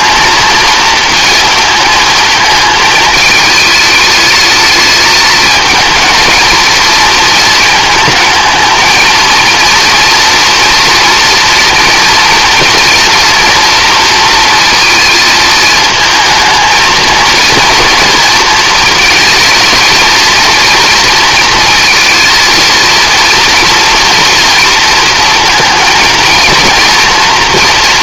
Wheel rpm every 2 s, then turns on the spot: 220, 220, 220, 230, 220, 230, 230, 230, 230, 230, 230, 230, 230, 230.
none